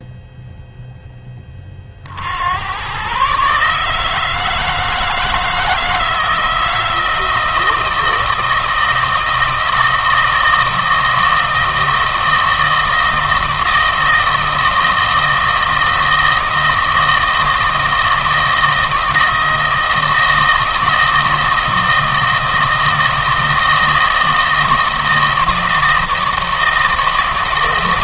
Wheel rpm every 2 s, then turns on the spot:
0, 100, 160, 160, 160, 160, 160, 160, 160, 160, 160, 160, 160, 160.
none